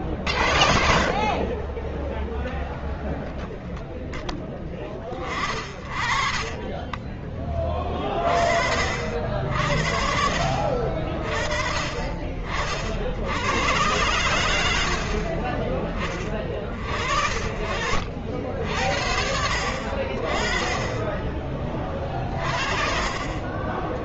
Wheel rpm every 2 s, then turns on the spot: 50, 0, 20, 20, 50, 30, 60, 80, 40, 60, 20, 40.
none